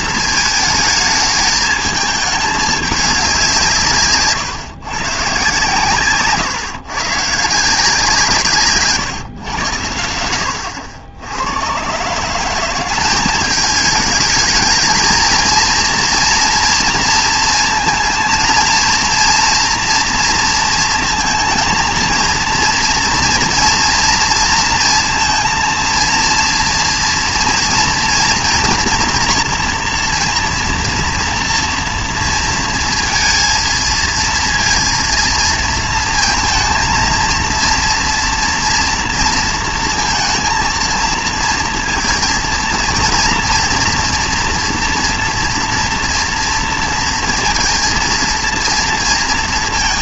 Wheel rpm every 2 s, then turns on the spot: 220, 210, 130, 130, 140, 80, 190, 220, 230, 230, 230, 230, 230, 230, 230, 240, 230, 230, 230, 240, 230, 230, 230, 230, 230.
none